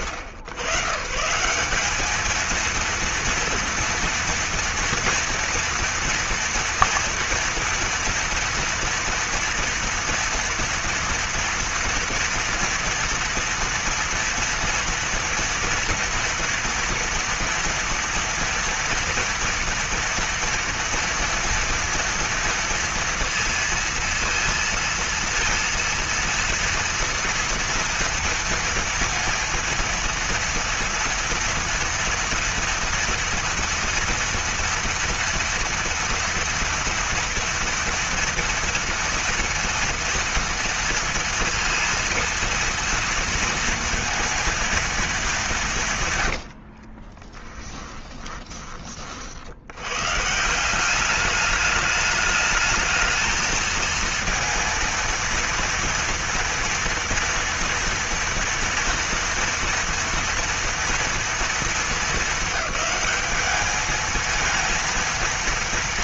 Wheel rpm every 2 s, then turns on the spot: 130, 220, 230, 230, 230, 230, 230, 230, 230, 230, 230, 230, 230, 230, 230, 230, 230, 240, 230, 230, 230, 230, 230, 70, 20, 170, 210, 230, 230, 230, 230, 220, 230.
46-48